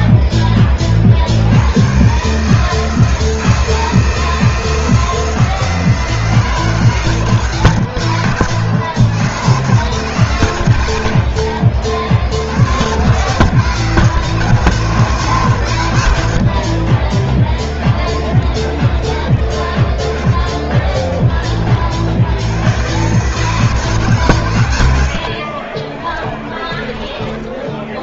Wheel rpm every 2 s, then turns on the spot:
40, 150, 160, 150, 110, 110, 80, 140, 50, 30, 20, 110, 100, 20.
16-20 26-28